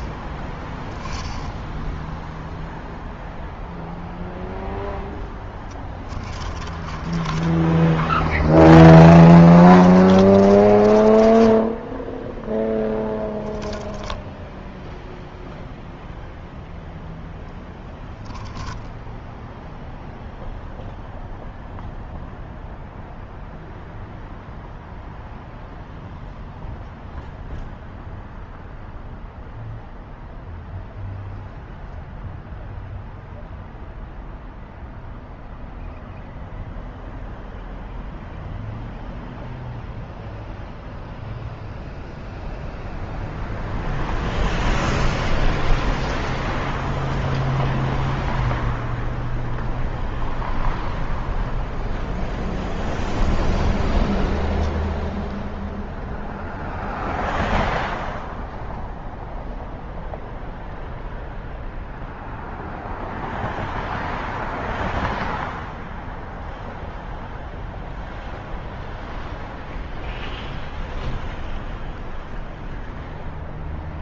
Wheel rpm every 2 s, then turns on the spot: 10, 0, 10, 20, 20, 20, 10, 0, 10, 10, 0, 0, 0, 0, 0, 0, 0, 0, 0, 0, 0, 0, 0, 0, 0, 0, 0, 0, 0, 0, 0, 0, 0, 0, 0, 0, 0.
4-14 18-20